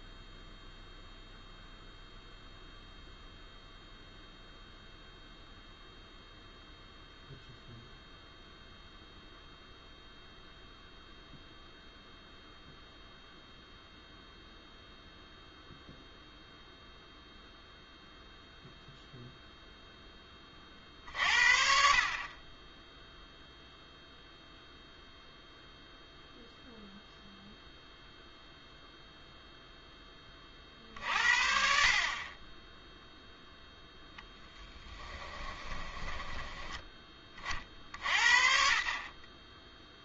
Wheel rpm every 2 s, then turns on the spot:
0, 0, 0, 0, 0, 0, 0, 0, 0, 0, 20, 30, 0, 0, 0, 40, 20, 10, 10, 60.
none